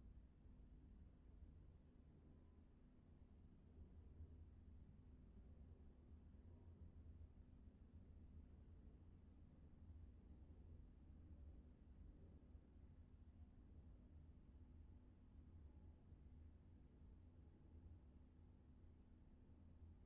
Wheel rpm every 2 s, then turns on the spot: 0, 0, 0, 0, 0, 0, 0, 0, 0, 0.
none